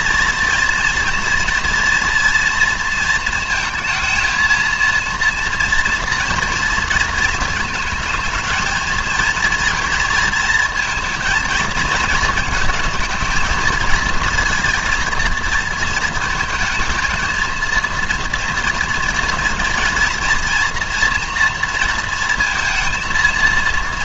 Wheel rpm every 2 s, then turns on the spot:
230, 230, 230, 230, 220, 230, 220, 230, 230, 230, 240, 230.
none